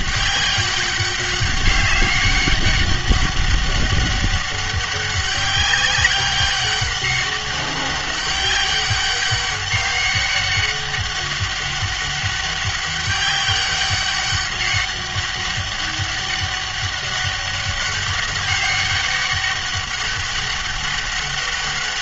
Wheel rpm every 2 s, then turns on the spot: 200, 200, 200, 200, 190, 200, 200, 200, 200, 200, 200.
none